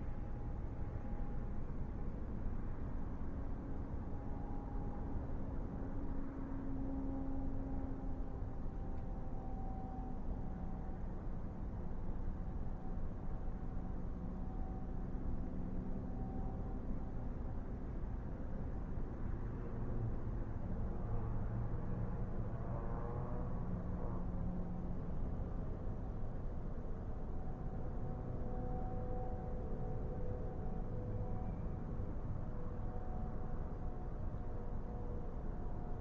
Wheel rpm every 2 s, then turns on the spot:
0, 0, 0, 0, 0, 0, 0, 0, 0, 0, 0, 0, 0, 0, 0, 0, 0, 0.
none